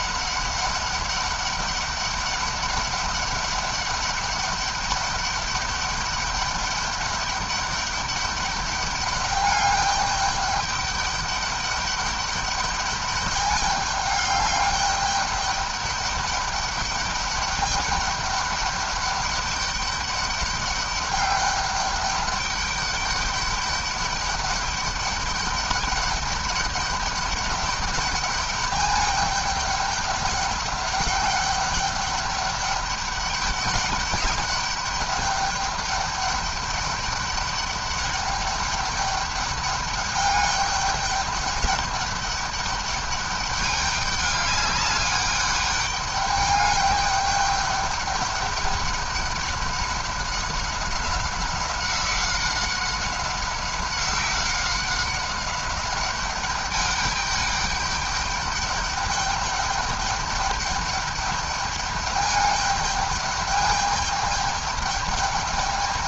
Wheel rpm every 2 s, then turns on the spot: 200, 200, 200, 200, 200, 200, 200, 200, 200, 200, 200, 200, 200, 200, 210, 200, 200, 200, 200, 200, 200, 200, 200, 210, 200, 190, 190, 190, 200, 210, 200, 210, 210.
none